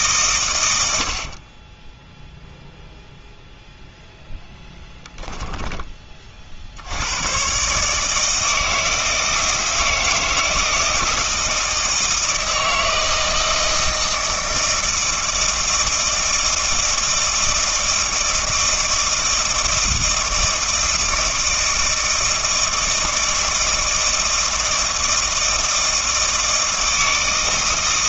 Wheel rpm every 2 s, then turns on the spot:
110, 0, 10, 70, 160, 160, 160, 160, 160, 160, 160, 160, 160, 160.
4-6